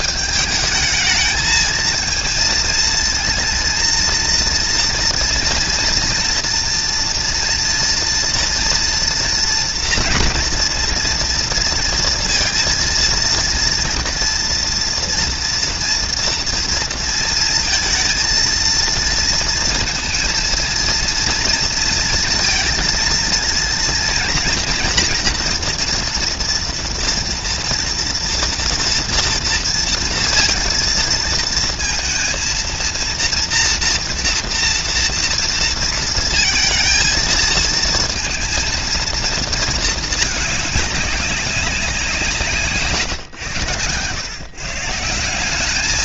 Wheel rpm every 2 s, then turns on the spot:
220, 230, 230, 230, 230, 230, 230, 230, 230, 230, 230, 230, 230, 230, 230, 230, 230, 230, 230, 230, 210, 140, 160.
none